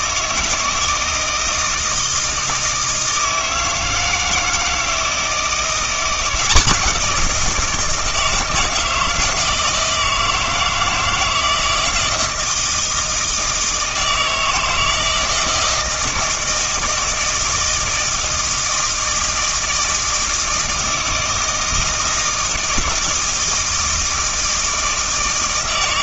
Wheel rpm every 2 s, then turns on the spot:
160, 160, 160, 170, 160, 160, 160, 160, 160, 160, 160, 160, 160.
none